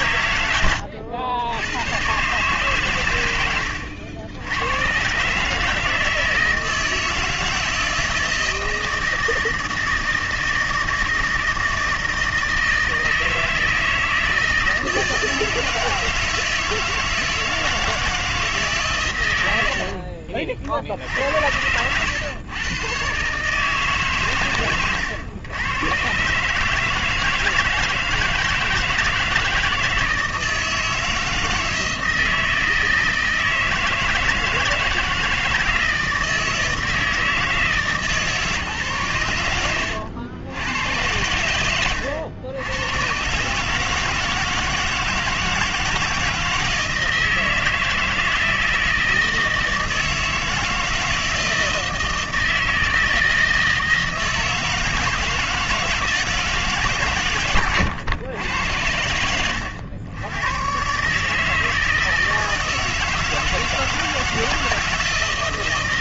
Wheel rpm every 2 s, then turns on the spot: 110, 130, 90, 160, 160, 160, 160, 160, 160, 150, 60, 110, 130, 150, 160, 160, 160, 160, 160, 140, 110, 100, 160, 160, 160, 160, 160, 160, 150, 100, 120, 160, 160.
none